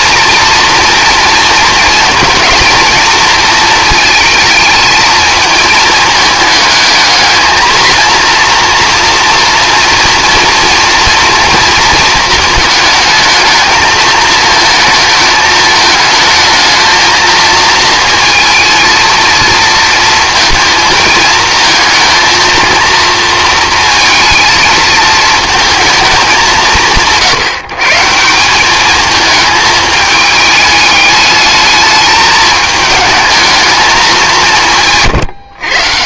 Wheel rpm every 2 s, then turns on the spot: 230, 230, 220, 220, 240, 240, 220, 220, 220, 220, 220, 230, 220, 180, 200, 210, 210, 170.
none